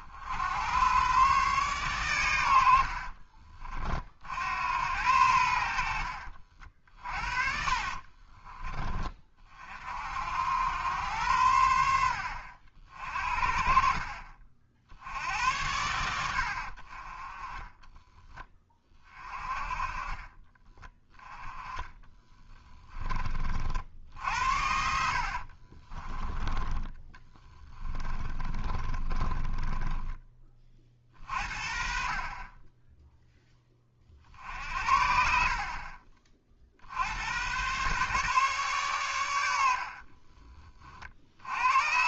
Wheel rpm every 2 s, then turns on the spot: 110, 70, 80, 50, 20, 100, 60, 70, 50, 20, 20, 20, 70, 20, 20, 40, 10, 60, 60, 120, 40.
2-4 6-8 20-26 28-30 34-36